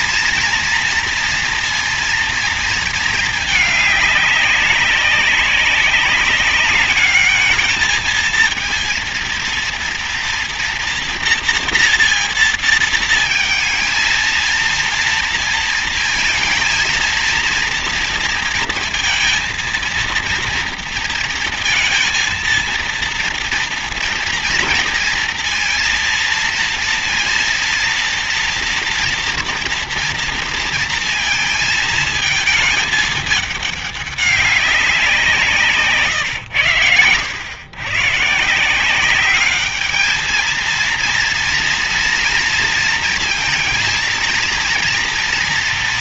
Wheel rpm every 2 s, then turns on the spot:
230, 230, 200, 200, 230, 240, 230, 230, 230, 230, 230, 230, 230, 230, 230, 230, 220, 200, 110, 150, 220, 230, 230.
none